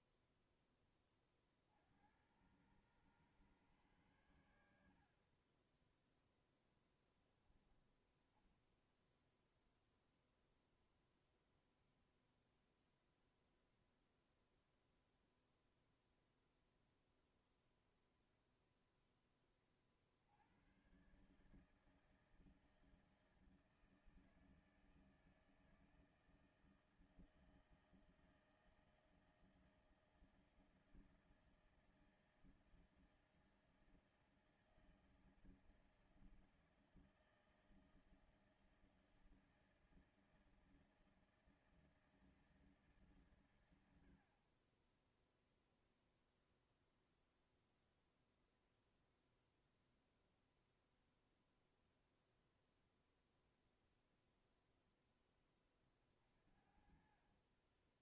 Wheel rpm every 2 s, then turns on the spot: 10, 90, 110, 10, 0, 0, 0, 0, 0, 0, 80, 160, 160, 160, 160, 160, 160, 160, 160, 160, 160, 160, 50, 0, 0, 0, 0, 0, 40.
6-8